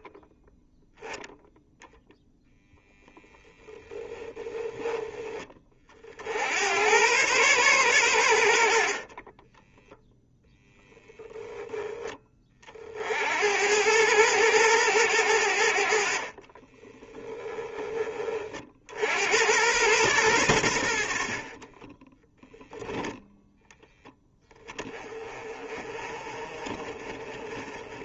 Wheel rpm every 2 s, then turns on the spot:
0, 0, 10, 100, 60, 0, 40, 110, 20, 60, 80, 0, 20, 30.
16-18